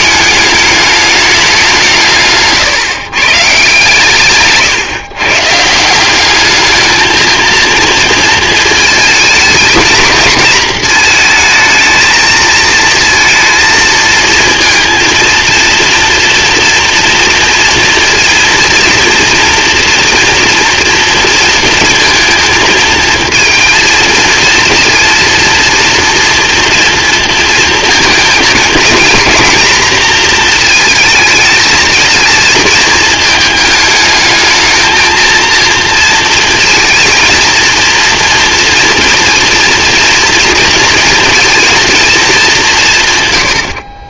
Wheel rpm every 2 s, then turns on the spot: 210, 140, 140, 210, 220, 230, 230, 230, 230, 230, 230, 230, 230, 230, 230, 230, 220, 220, 230, 230, 230, 180.
none